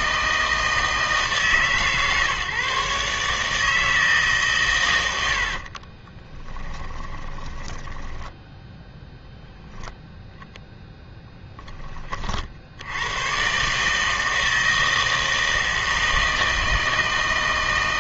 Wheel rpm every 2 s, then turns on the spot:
160, 140, 130, 20, 0, 0, 70, 160, 160.
6-8